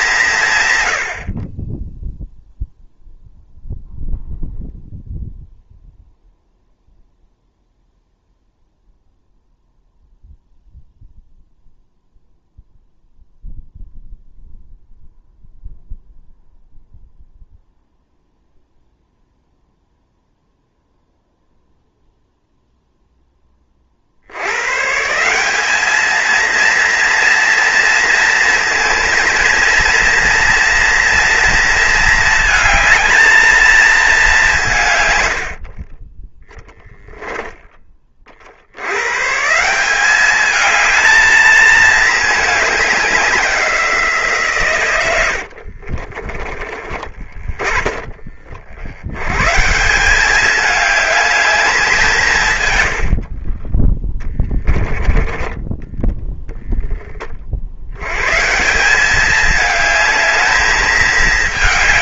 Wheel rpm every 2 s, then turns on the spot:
120, 0, 0, 0, 0, 0, 0, 0, 0, 0, 0, 0, 130, 230, 230, 230, 220, 140, 0, 70, 210, 200, 110, 20, 70, 210, 110, 10, 20, 170, 220.
54-56